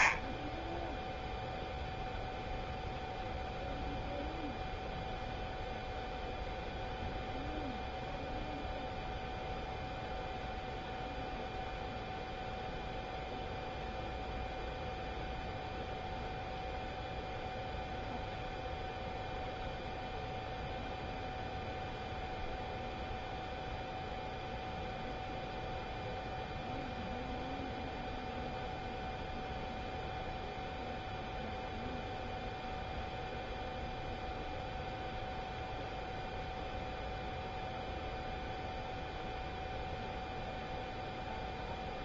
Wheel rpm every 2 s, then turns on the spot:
20, 0, 0, 0, 0, 0, 0, 0, 0, 0, 0, 0, 0, 0, 0, 0, 0, 0, 0, 0, 0.
none